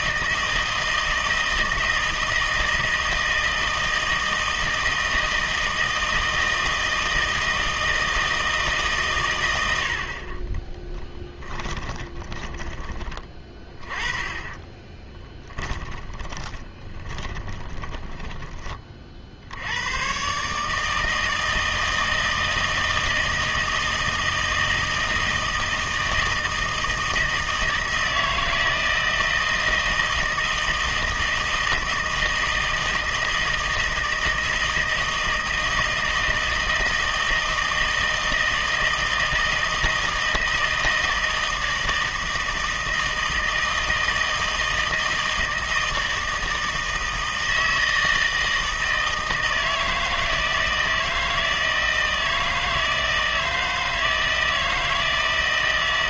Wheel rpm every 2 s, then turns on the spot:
160, 160, 160, 160, 140, 10, 20, 20, 30, 50, 160, 160, 160, 160, 160, 160, 160, 160, 160, 160, 160, 160, 160, 160, 160, 160, 160, 160.
10-18